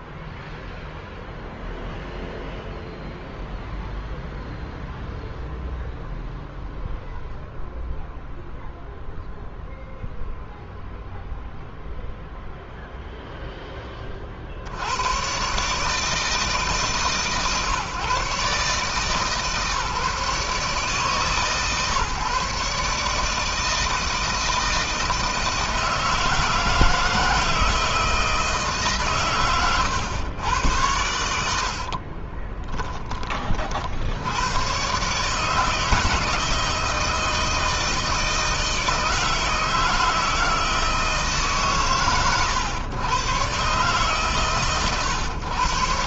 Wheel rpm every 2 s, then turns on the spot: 0, 0, 0, 0, 0, 0, 0, 80, 150, 150, 140, 150, 160, 160, 130, 100, 20, 120, 160, 160, 160, 110, 130.
none